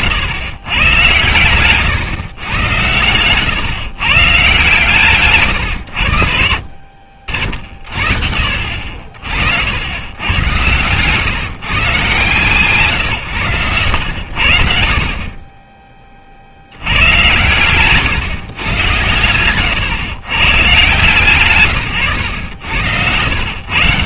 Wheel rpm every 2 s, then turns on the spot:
120, 110, 150, 50, 60, 110, 150, 70, 80, 120, 130, 90.
10-12